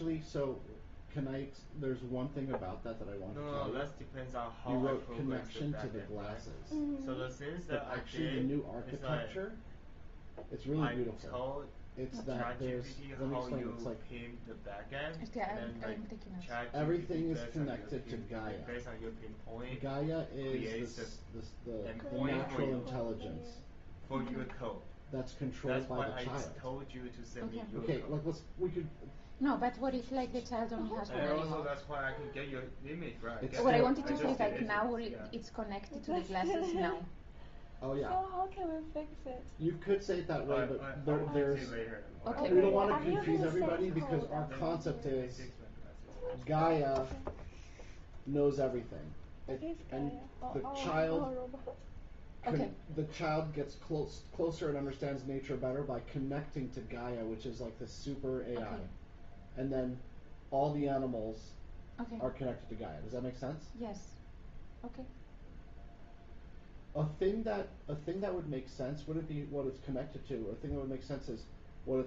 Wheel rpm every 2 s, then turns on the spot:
0, 0, 0, 0, 0, 0, 0, 0, 0, 0, 0, 0, 0, 0, 0, 0, 0, 0, 0, 0, 0, 0, 0, 0, 0, 0, 0, 0, 0, 0, 0, 0, 0, 0, 0, 0.
none